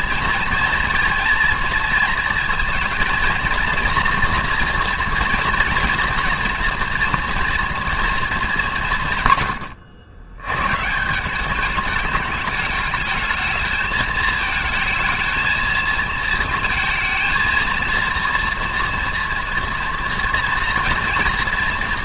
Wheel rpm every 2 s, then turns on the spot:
230, 230, 230, 240, 210, 120, 210, 220, 230, 230, 230.
none